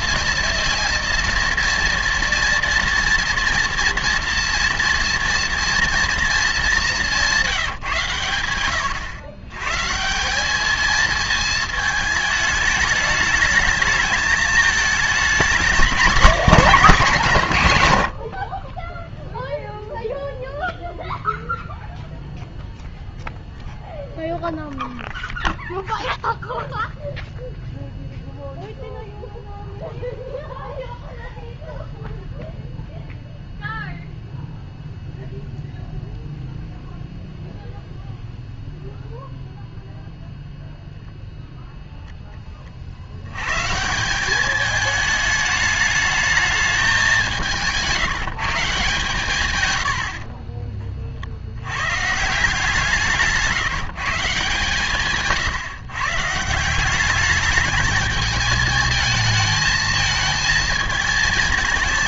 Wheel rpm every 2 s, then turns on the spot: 230, 240, 240, 220, 110, 210, 210, 220, 220, 40, 0, 0, 0, 0, 0, 0, 0, 0, 0, 0, 0, 40, 210, 210, 160, 30, 160, 150, 180, 220, 220.
50-52